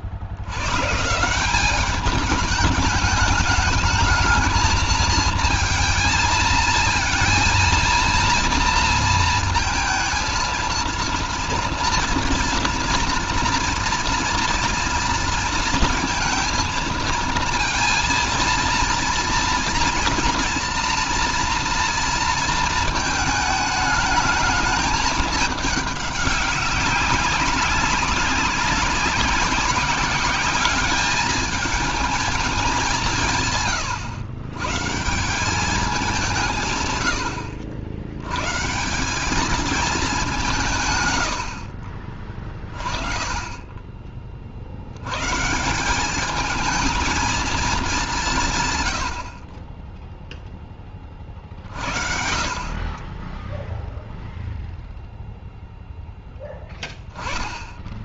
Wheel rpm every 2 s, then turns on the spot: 120, 210, 220, 230, 230, 230, 230, 230, 230, 230, 230, 220, 210, 200, 190, 200, 210, 130, 140, 160, 150, 20, 70, 220, 110, 20, 30, 0, 10.
none